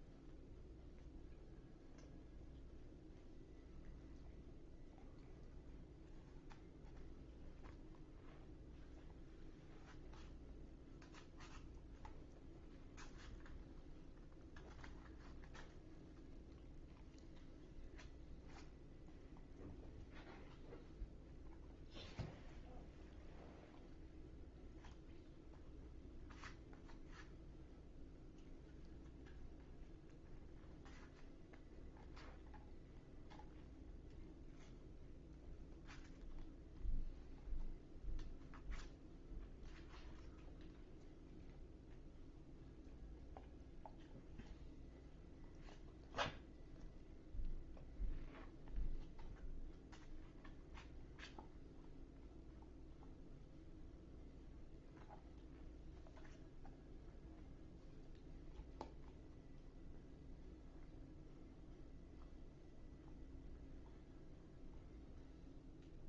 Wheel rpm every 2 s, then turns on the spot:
0, 0, 0, 0, 0, 0, 0, 0, 0, 0, 0, 0, 0, 0, 0, 0, 0, 0, 0, 0, 0, 0, 0, 0, 0, 0, 0, 0, 0, 0, 0, 0, 0.
none